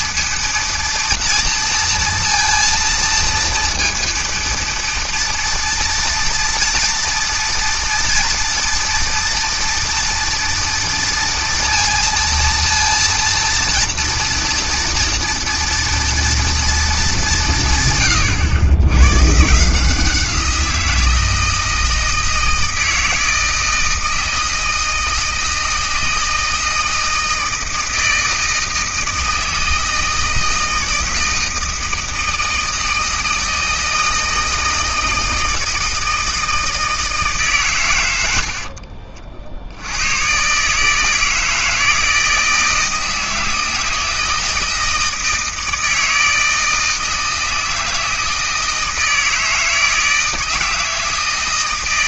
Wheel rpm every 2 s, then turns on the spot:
230, 230, 230, 230, 230, 230, 230, 240, 230, 100, 170, 160, 160, 160, 160, 160, 160, 160, 160, 60, 140, 160, 160, 160, 160, 160.
38-40